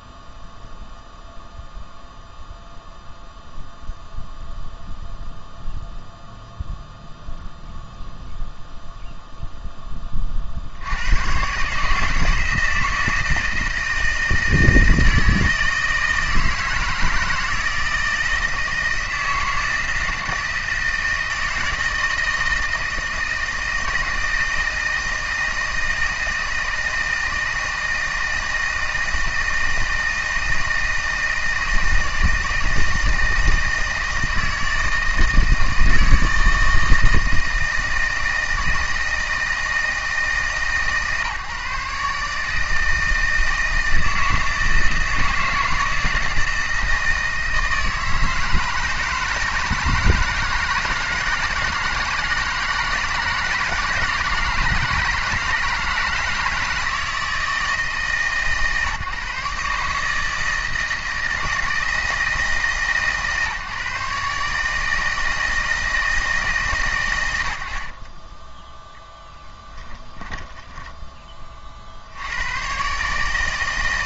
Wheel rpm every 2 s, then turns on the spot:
0, 0, 0, 0, 0, 30, 160, 160, 160, 160, 160, 160, 160, 160, 160, 160, 160, 160, 160, 160, 160, 150, 160, 160, 160, 160, 160, 160, 160, 150, 160, 160, 150, 160, 30, 10, 80.
70-72